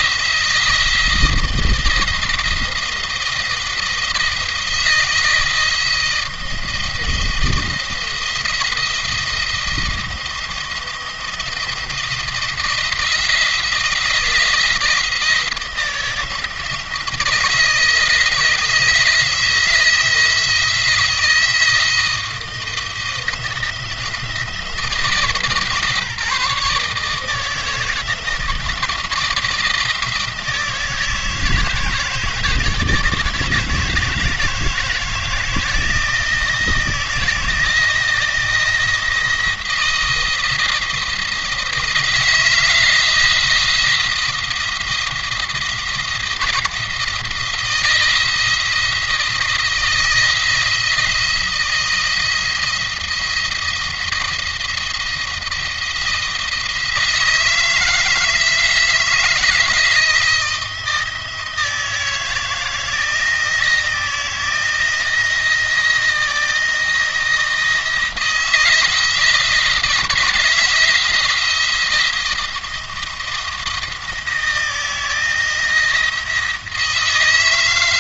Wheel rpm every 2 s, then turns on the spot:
170, 170, 170, 170, 170, 170, 170, 170, 160, 160, 160, 160, 160, 160, 160, 160, 160, 160, 160, 170, 170, 170, 170, 170, 170, 170, 170, 170, 170, 160, 160, 170, 170, 170, 170, 170, 160, 170, 160.
none